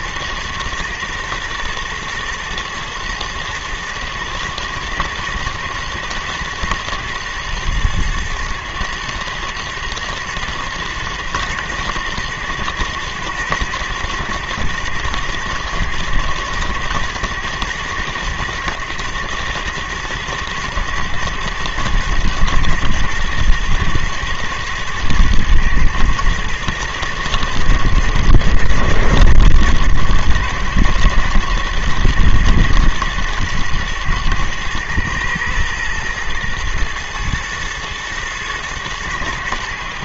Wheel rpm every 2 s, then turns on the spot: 120, 120, 110, 110, 110, 110, 120, 120, 120, 110, 110, 120, 110, 120, 110, 120, 110, 110, 120, 110.
none